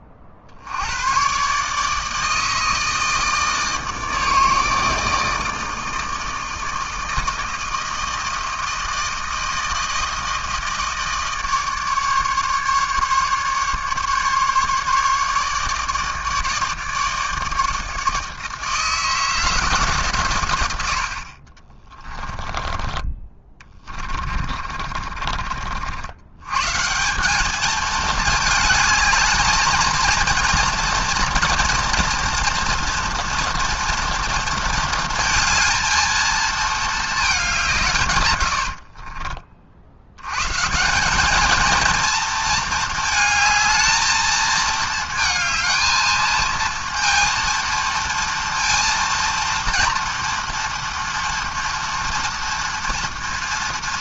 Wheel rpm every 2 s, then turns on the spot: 130, 160, 160, 160, 160, 160, 150, 150, 160, 160, 40, 20, 60, 190, 220, 230, 230, 230, 200, 40, 210, 220, 220, 230, 230, 230, 230.
22-26 38-40